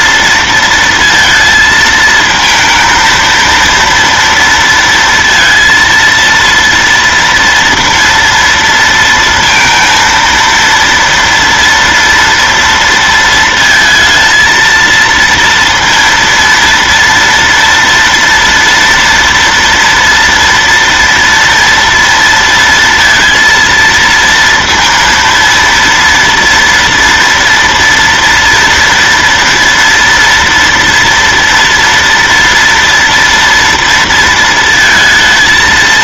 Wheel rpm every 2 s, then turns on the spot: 230, 230, 230, 230, 230, 230, 230, 230, 230, 230, 230, 230, 230, 230, 230, 230, 240, 230.
none